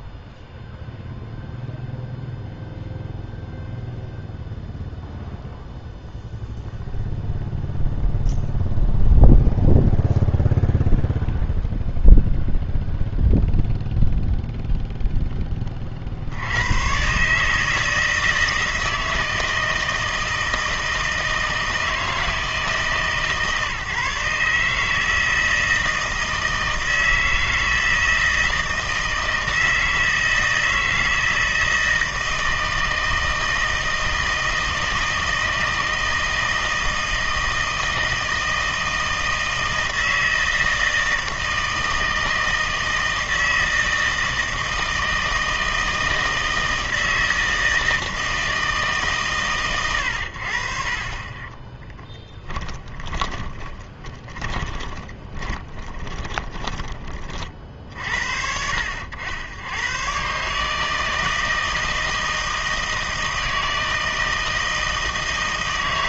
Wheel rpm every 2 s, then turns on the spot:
0, 0, 0, 0, 0, 0, 0, 0, 90, 160, 160, 150, 150, 160, 160, 160, 160, 160, 160, 160, 160, 160, 160, 160, 160, 60, 20, 20, 20, 60, 150, 160, 160.
52-58